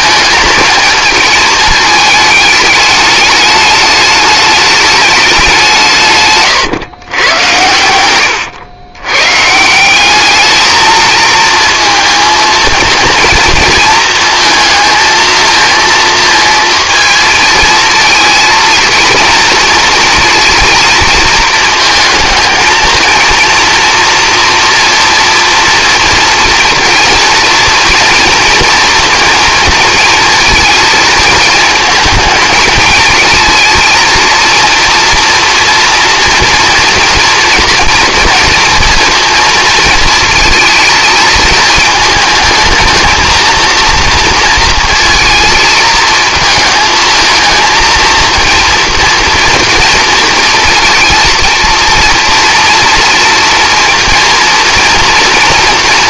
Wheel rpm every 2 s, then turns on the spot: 220, 210, 210, 130, 100, 220, 230, 230, 230, 230, 230, 220, 230, 230, 230, 220, 220, 230, 230, 230, 220, 220, 230, 220, 230, 230, 230, 230.
none